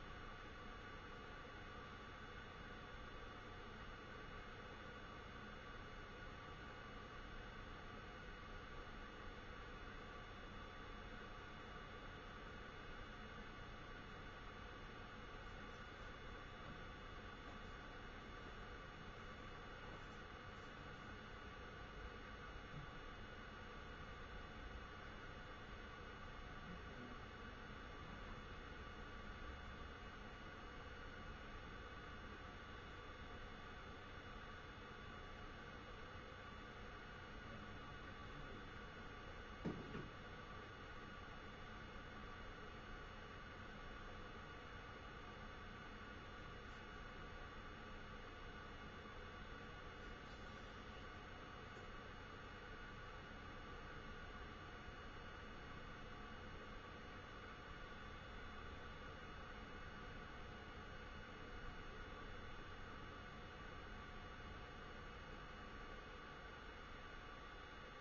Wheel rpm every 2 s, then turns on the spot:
0, 0, 0, 0, 0, 0, 0, 0, 0, 0, 0, 0, 0, 0, 0, 0, 0, 0, 0, 0, 0, 0, 0, 0, 0, 0, 0, 0, 0, 0, 0, 0, 0, 0.
none